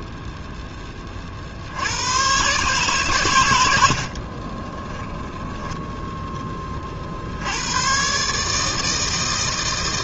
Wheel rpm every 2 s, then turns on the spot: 0, 120, 30, 10, 150.
4-6